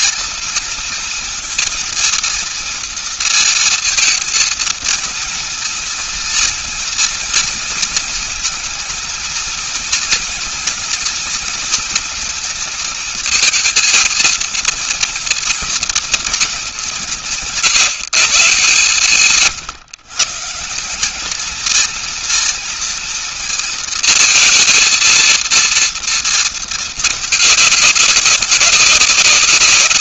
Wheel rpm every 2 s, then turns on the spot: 230, 230, 230, 240, 230, 230, 220, 230, 180, 140, 180, 230, 230, 220, 180.
none